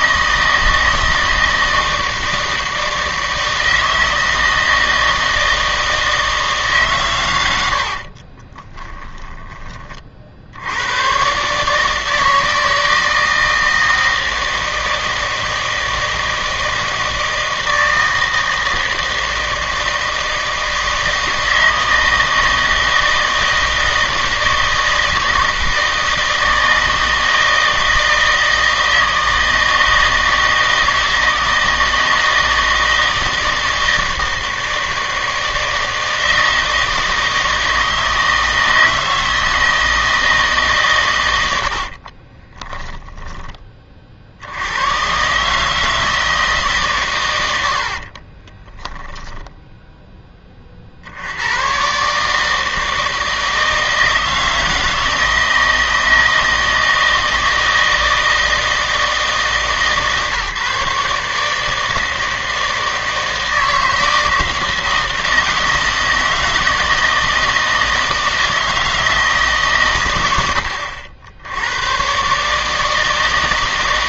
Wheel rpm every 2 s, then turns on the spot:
160, 160, 160, 150, 20, 80, 160, 160, 160, 160, 160, 160, 160, 160, 160, 160, 160, 160, 160, 160, 150, 10, 100, 140, 20, 40, 160, 160, 160, 160, 150, 160, 160, 160, 160, 80, 160.
8-10 42-44 48-50